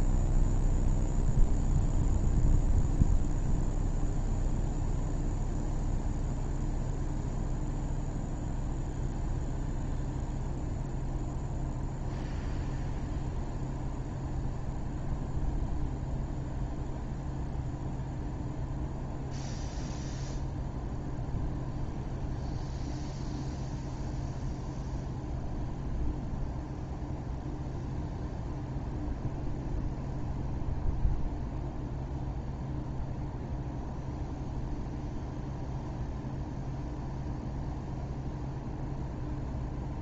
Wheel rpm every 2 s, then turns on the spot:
0, 0, 0, 0, 0, 0, 0, 0, 0, 0, 0, 0, 0, 0, 0, 0, 0, 0, 0, 0.
none